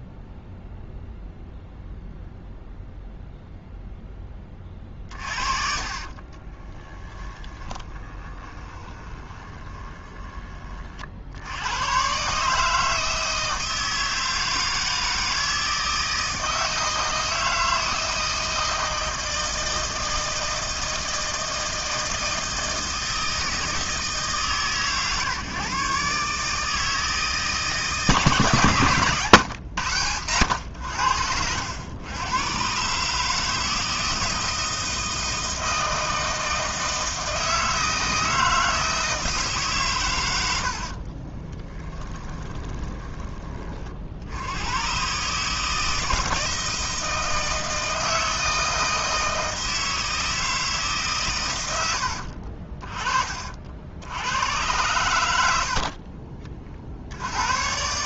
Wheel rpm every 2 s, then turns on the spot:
0, 0, 30, 20, 20, 40, 160, 160, 160, 160, 160, 160, 130, 160, 140, 90, 130, 160, 160, 160, 70, 20, 110, 160, 160, 150, 40, 100, 50.
4-10 40-44